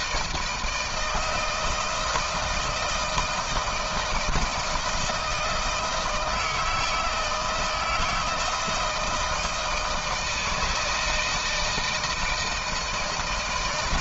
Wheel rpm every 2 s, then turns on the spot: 160, 160, 170, 160, 160, 160, 160.
none